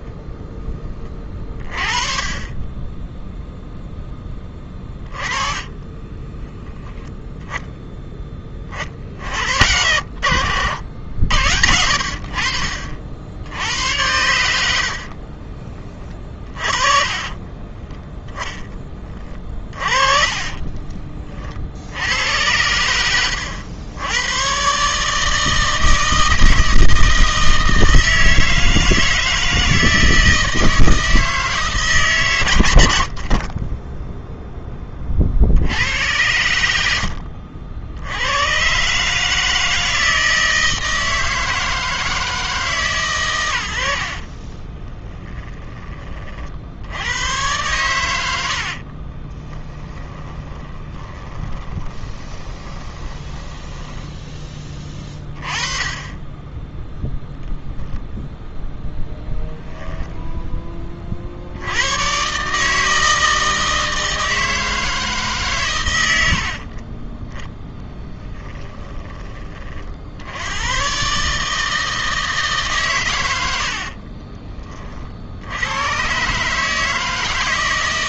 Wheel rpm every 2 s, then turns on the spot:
10, 10, 20, 10, 40, 80, 50, 80, 40, 10, 30, 90, 140, 160, 160, 160, 120, 20, 80, 130, 160, 150, 20, 80, 50, 20, 20, 20, 0, 0, 20, 160, 160, 30, 10, 110, 130, 40, 150.
4-6 14-18 20-22 36-38 44-46 48-54 66-68